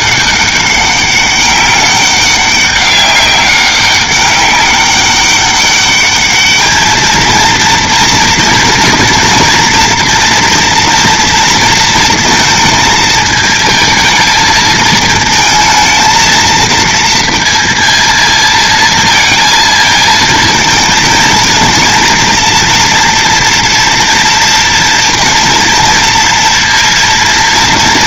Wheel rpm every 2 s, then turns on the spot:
200, 200, 200, 220, 230, 230, 230, 220, 230, 230, 220, 230, 230, 230.
none